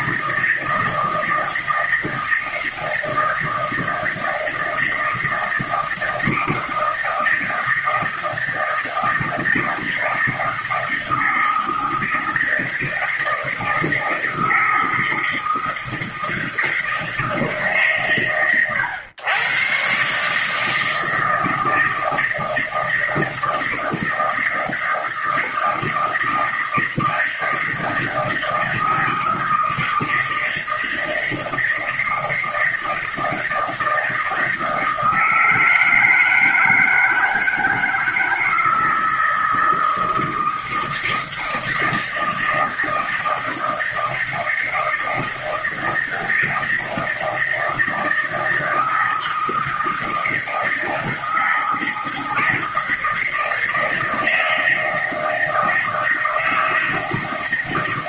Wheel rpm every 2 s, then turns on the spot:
160, 160, 160, 160, 160, 160, 160, 160, 170, 110, 160, 160, 160, 160, 160, 160, 160, 160, 160, 160, 160, 160, 160, 160, 160, 160, 160, 160, 160.
none